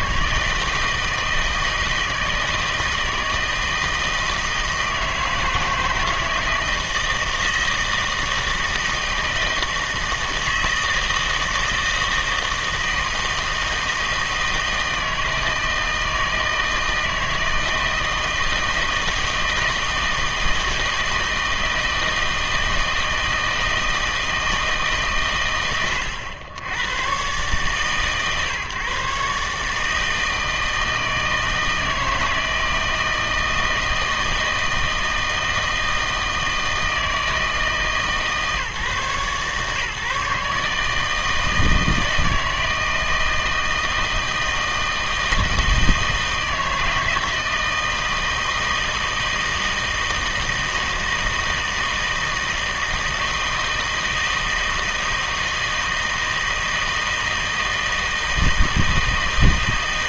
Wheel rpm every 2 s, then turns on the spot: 160, 160, 160, 160, 160, 160, 160, 160, 160, 160, 160, 160, 150, 90, 130, 160, 160, 160, 160, 140, 150, 160, 160, 160, 160, 160, 160, 160, 160, 160.
none